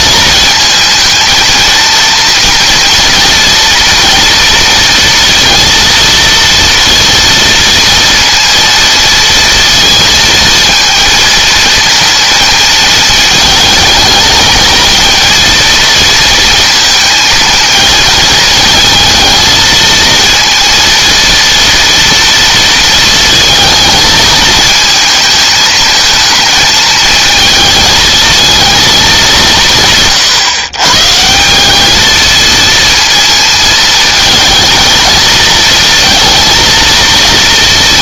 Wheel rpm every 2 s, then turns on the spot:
220, 240, 230, 230, 230, 230, 220, 220, 230, 220, 230, 230, 220, 220, 220, 140, 230, 220, 220.
none